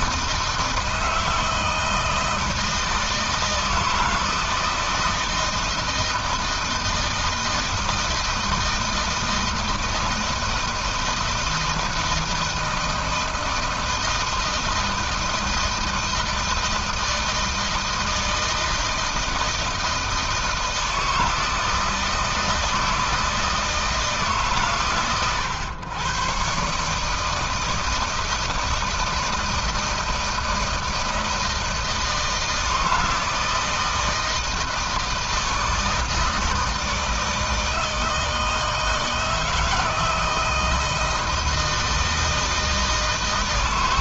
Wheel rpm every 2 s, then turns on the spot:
160, 160, 160, 160, 160, 170, 160, 160, 160, 160, 160, 160, 140, 140, 160, 160, 160, 160, 160, 160, 160, 160.
none